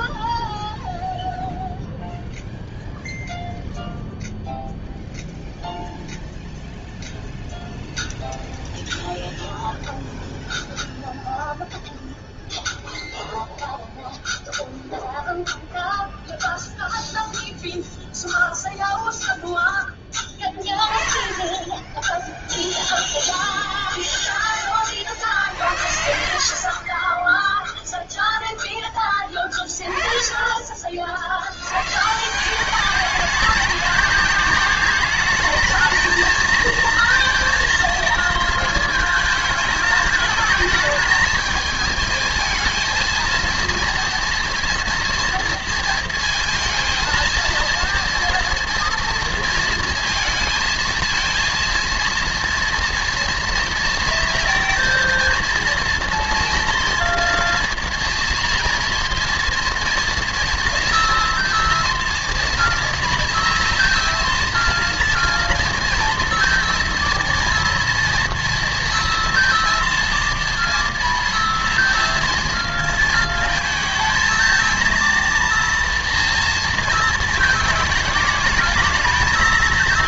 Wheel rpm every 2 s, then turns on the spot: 0, 0, 0, 0, 0, 0, 0, 0, 0, 0, 20, 0, 10, 40, 0, 20, 190, 210, 230, 230, 220, 220, 240, 230, 230, 230, 230, 240, 230, 240, 230, 230, 240, 240, 240, 230, 230, 230, 230, 210.
26-28